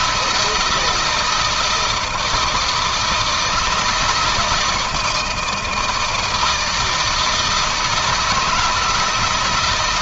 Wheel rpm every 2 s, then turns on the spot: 160, 160, 170, 160, 160.
none